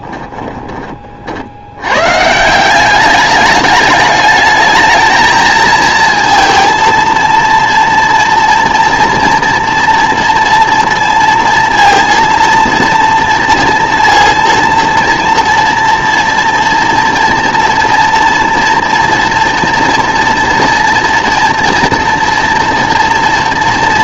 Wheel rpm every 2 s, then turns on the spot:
30, 180, 210, 230, 230, 230, 240, 230, 230, 240, 240, 230.
none